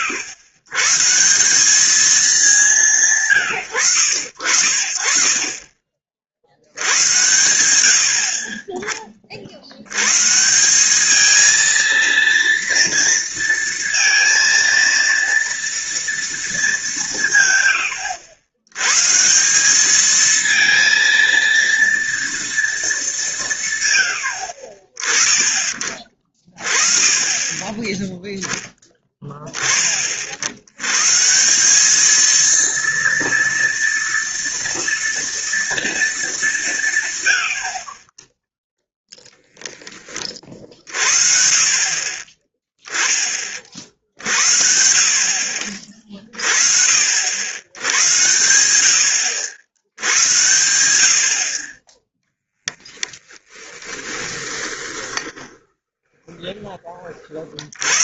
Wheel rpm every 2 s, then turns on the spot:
120, 190, 70, 80, 30, 190, 230, 230, 200, 110, 230, 220, 50, 40, 10, 100, 230, 230, 170, 0, 50, 20, 60, 50, 90, 80, 20, 20, 30.
54-56